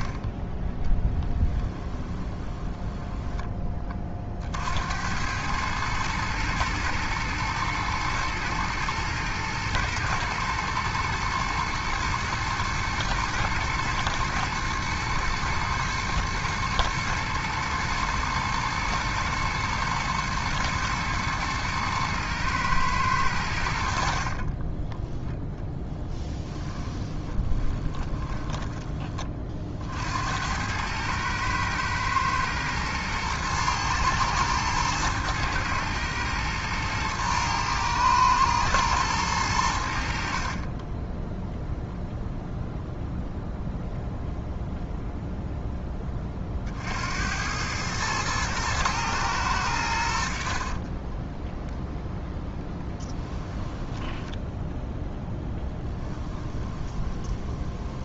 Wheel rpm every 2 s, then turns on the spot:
20, 10, 70, 110, 110, 110, 110, 110, 120, 110, 110, 110, 20, 20, 20, 100, 110, 110, 110, 110, 30, 0, 0, 60, 110, 30, 10, 0, 20.
2-4 24-28 40-42 50-54 56-58